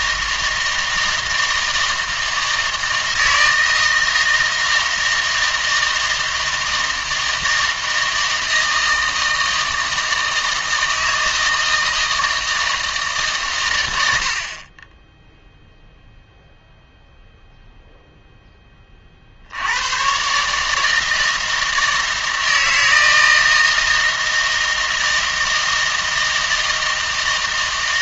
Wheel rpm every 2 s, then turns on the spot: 160, 160, 160, 160, 160, 160, 160, 30, 0, 20, 150, 160, 160, 160.
none